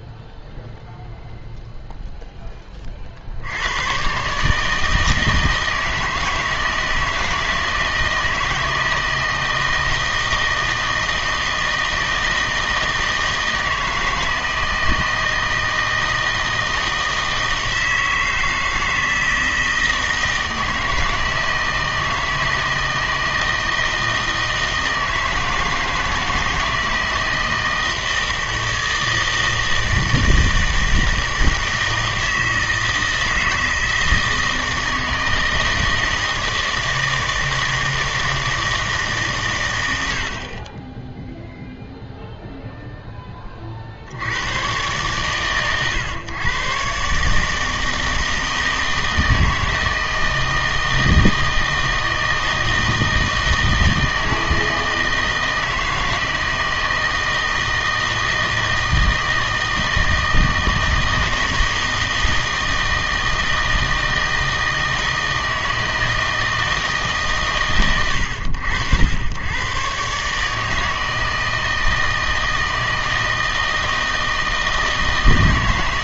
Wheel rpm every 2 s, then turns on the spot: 0, 20, 150, 160, 160, 160, 160, 160, 160, 160, 160, 160, 160, 160, 160, 160, 160, 160, 160, 160, 40, 0, 100, 120, 160, 160, 160, 160, 160, 160, 160, 160, 160, 160, 90, 150, 160, 160.
none